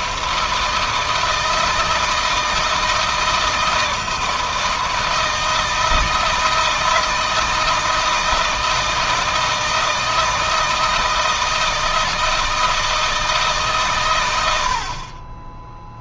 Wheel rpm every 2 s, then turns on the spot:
160, 160, 160, 160, 160, 160, 160, 40.
none